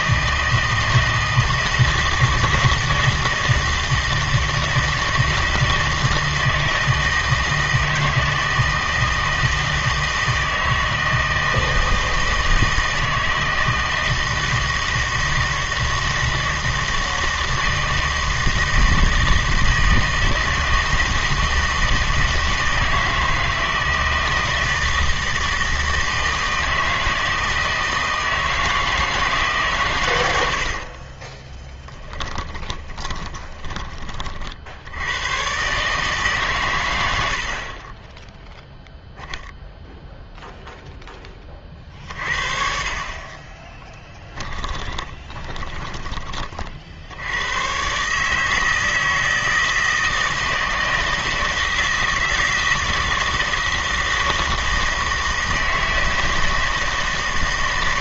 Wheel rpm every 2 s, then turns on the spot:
160, 160, 160, 160, 160, 160, 160, 160, 160, 160, 160, 160, 160, 160, 160, 60, 20, 60, 120, 0, 0, 50, 20, 60, 160, 160, 160, 160, 160.
30-34 44-46